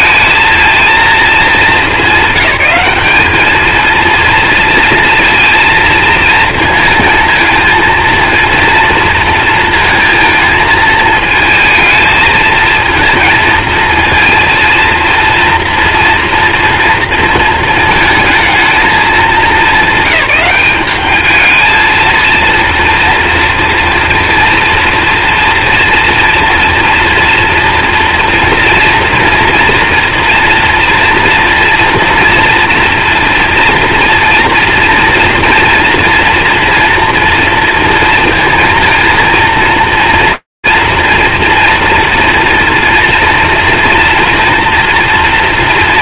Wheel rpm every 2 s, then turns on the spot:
230, 200, 230, 220, 230, 220, 220, 230, 230, 200, 200, 230, 230, 230, 240, 230, 230, 230, 230, 230, 240, 230, 240.
none